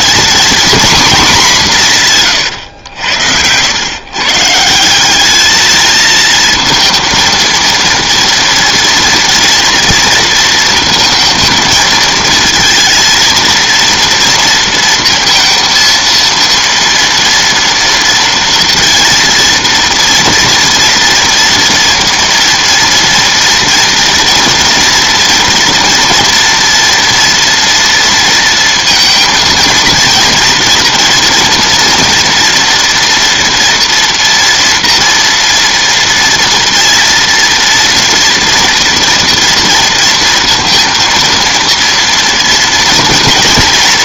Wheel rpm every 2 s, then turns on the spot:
240, 110, 170, 230, 230, 230, 230, 230, 230, 230, 230, 230, 230, 230, 230, 230, 230, 240, 230, 230, 230, 230.
none